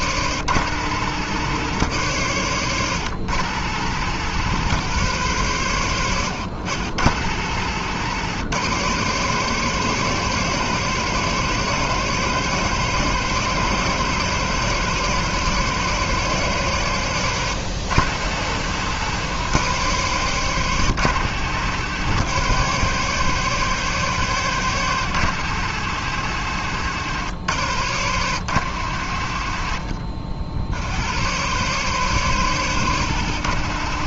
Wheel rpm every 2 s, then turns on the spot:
110, 120, 120, 100, 120, 140, 140, 140, 130, 110, 120, 130, 120, 110, 90, 80, 120.
none